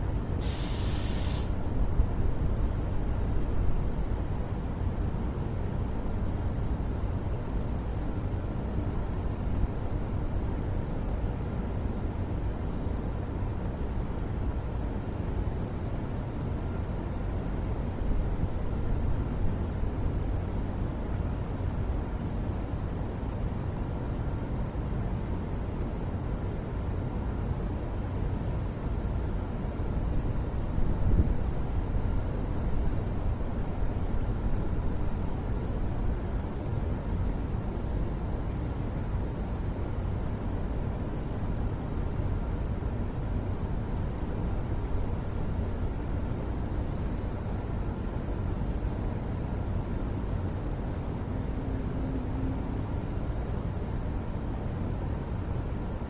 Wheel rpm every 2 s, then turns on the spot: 0, 0, 0, 0, 0, 0, 0, 0, 0, 0, 0, 0, 0, 0, 0, 0, 0, 0, 0, 0, 0, 0, 0, 0, 0, 0, 0, 0.
none